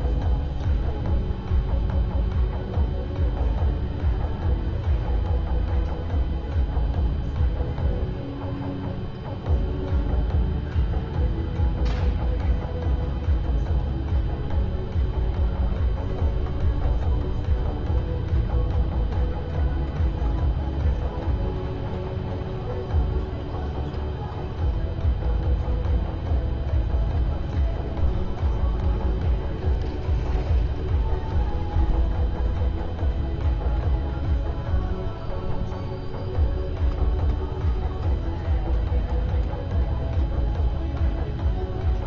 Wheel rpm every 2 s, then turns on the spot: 0, 0, 0, 0, 0, 0, 0, 0, 0, 0, 0, 0, 0, 0, 0, 0, 0, 0, 0, 0, 0.
none